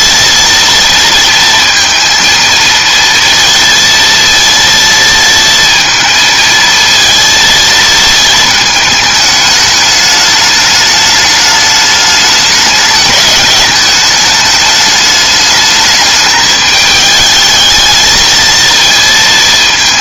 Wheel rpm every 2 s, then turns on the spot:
230, 230, 230, 230, 220, 210, 210, 210, 210, 230.
none